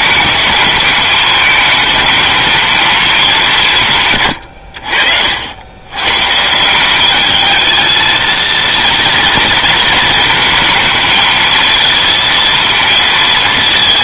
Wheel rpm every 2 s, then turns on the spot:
210, 220, 80, 180, 230, 220, 230.
none